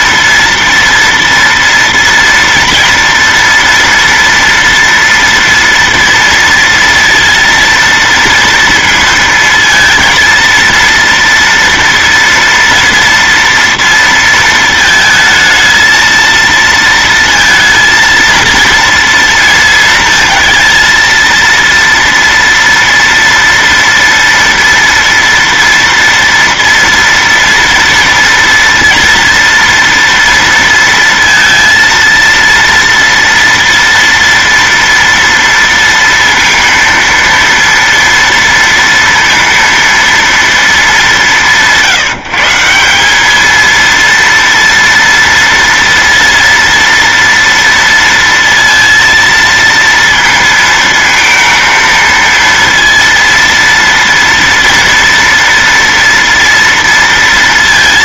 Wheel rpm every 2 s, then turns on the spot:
240, 230, 230, 230, 230, 230, 230, 220, 230, 230, 230, 230, 230, 230, 230, 230, 230, 230, 230, 230, 200, 190, 230, 230, 230, 230, 230, 230, 230.
none